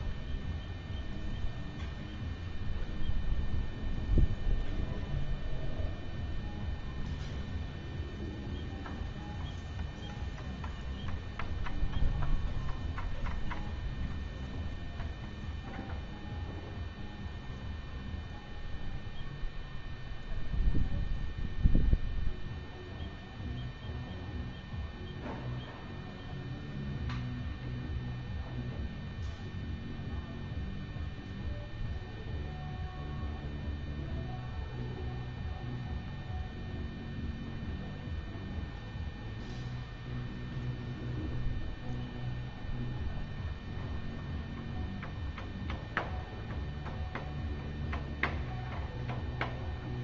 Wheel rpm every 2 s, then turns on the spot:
0, 0, 0, 0, 0, 0, 0, 0, 0, 0, 0, 0, 0, 0, 0, 0, 0, 0, 0, 0, 0, 0, 0, 0, 0.
none